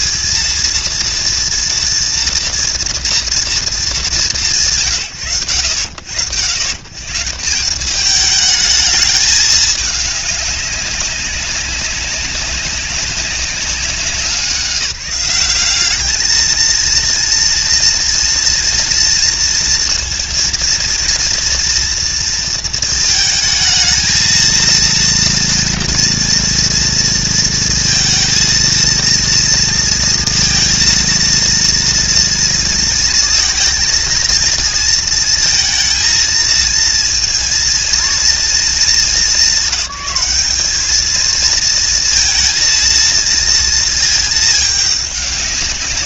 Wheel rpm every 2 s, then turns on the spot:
220, 230, 150, 90, 210, 200, 200, 190, 220, 230, 230, 230, 230, 230, 230, 230, 230, 230, 220, 220, 200, 230, 220.
none